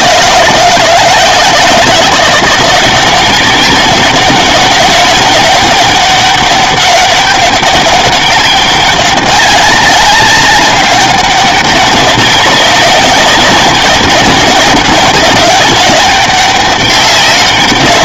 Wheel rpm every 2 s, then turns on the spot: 160, 180, 190, 200, 200, 190, 200, 200, 200.
none